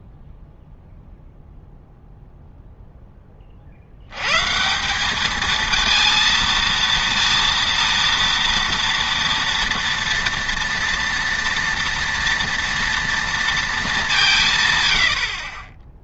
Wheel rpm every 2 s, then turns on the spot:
0, 0, 170, 230, 230, 230, 230, 120.
none